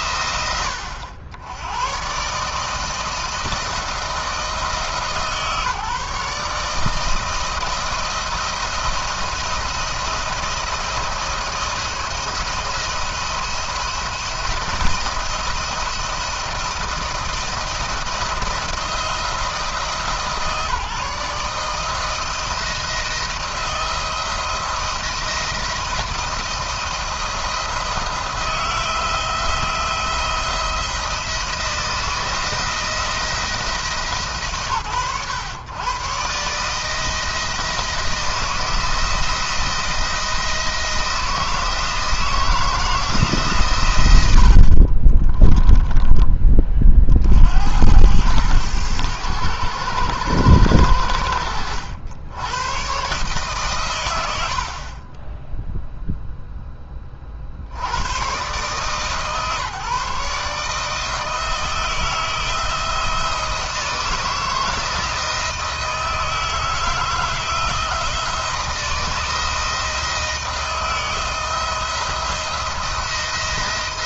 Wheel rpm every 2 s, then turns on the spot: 90, 160, 140, 160, 170, 170, 170, 170, 160, 160, 160, 170, 170, 170, 170, 160, 170, 120, 160, 160, 170, 160, 40, 30, 100, 90, 120, 40, 10, 130, 160, 170, 160, 160, 160, 160, 170.
44-46